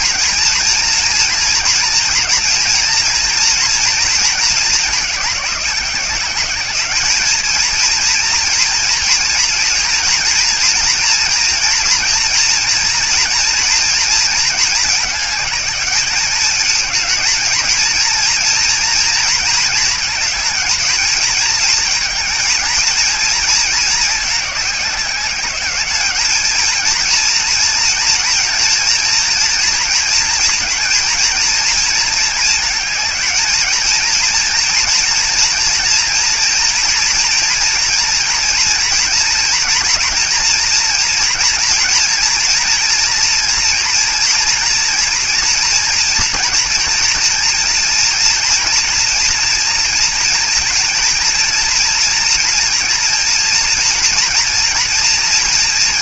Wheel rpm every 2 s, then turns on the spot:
230, 230, 220, 200, 230, 230, 230, 220, 210, 230, 220, 230, 200, 230, 230, 240, 220, 230, 230, 230, 230, 230, 230, 230, 240, 230, 230, 230.
none